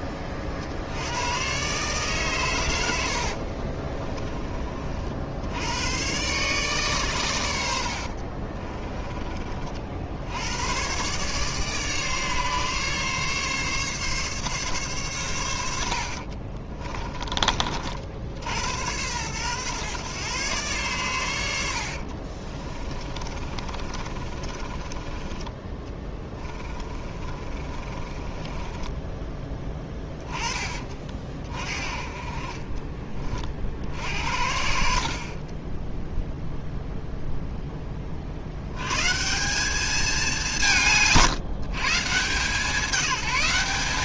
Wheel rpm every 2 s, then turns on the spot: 50, 90, 40, 140, 30, 100, 140, 140, 30, 90, 120, 30, 20, 20, 20, 30, 30, 50, 0, 100, 160, 180.
8-10 16-18 22-30